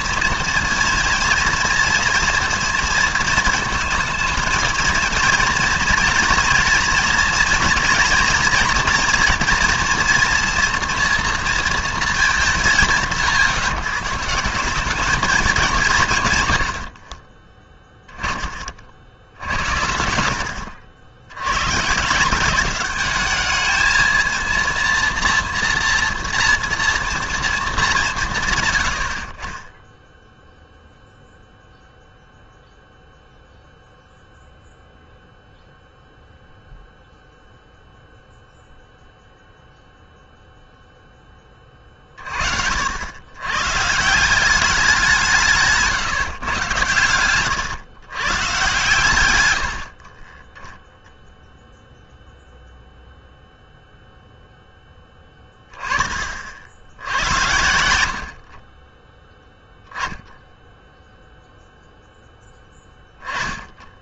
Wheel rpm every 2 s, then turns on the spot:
230, 230, 220, 230, 230, 230, 170, 180, 80, 40, 80, 190, 230, 230, 110, 0, 0, 0, 0, 0, 0, 70, 190, 120, 130, 0, 0, 10, 70, 30, 0, 10.
none